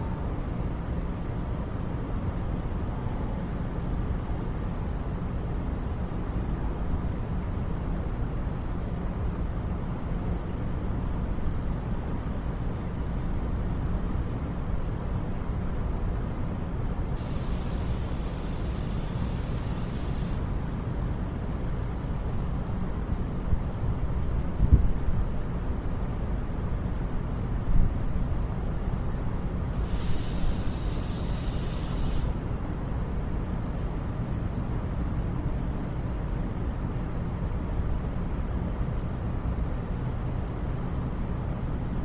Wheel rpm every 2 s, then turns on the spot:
0, 0, 0, 0, 0, 0, 0, 0, 0, 0, 0, 0, 0, 0, 0, 0, 0, 0, 0, 0, 0.
none